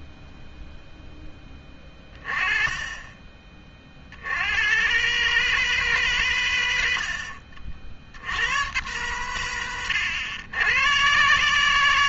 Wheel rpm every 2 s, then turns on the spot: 0, 30, 90, 120, 100, 110.
none